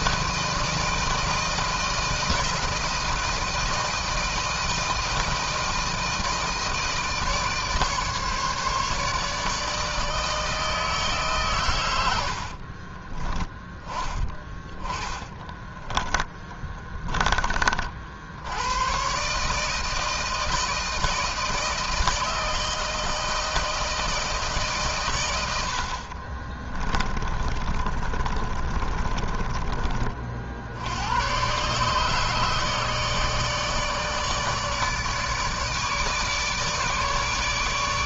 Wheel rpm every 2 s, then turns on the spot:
160, 160, 160, 160, 150, 150, 30, 20, 20, 120, 160, 160, 120, 20, 30, 90, 150, 150, 150.
12-16 26-30